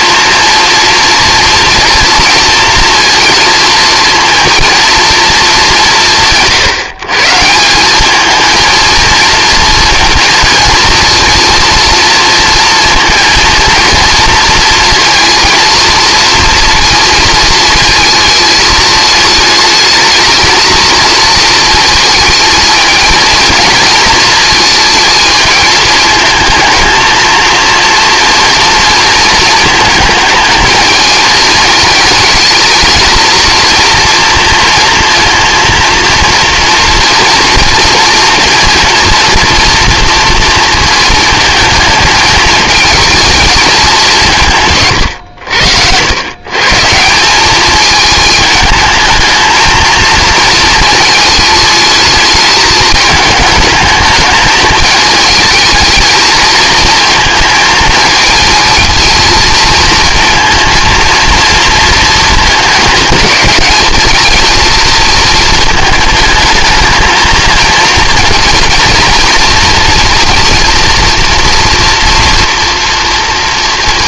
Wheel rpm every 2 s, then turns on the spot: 230, 230, 230, 140, 230, 230, 230, 230, 230, 220, 220, 220, 220, 220, 230, 220, 220, 230, 230, 230, 230, 220, 130, 150, 220, 220, 220, 210, 230, 230, 230, 220, 230, 220, 230, 230, 230.
none